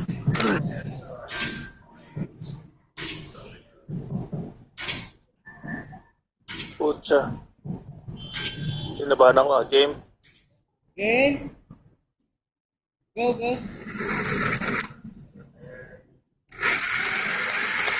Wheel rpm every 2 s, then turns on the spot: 0, 0, 0, 0, 0, 0, 10, 80, 110.
none